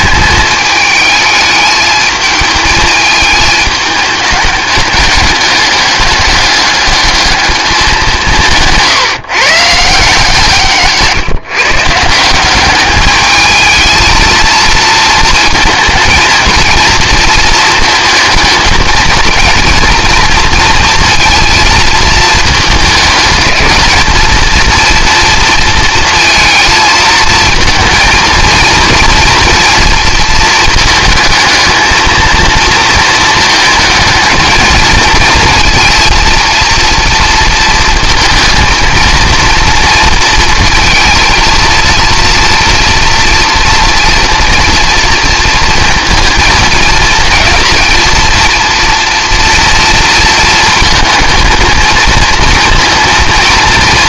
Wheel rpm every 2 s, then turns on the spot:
210, 220, 210, 210, 170, 160, 200, 230, 230, 220, 230, 220, 230, 230, 230, 220, 220, 220, 230, 220, 220, 230, 230, 220, 230, 220, 230.
8-12